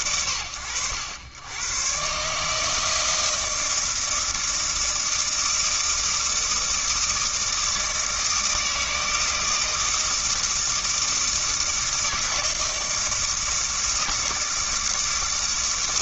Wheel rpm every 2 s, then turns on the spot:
80, 160, 160, 160, 160, 160, 160, 160.
none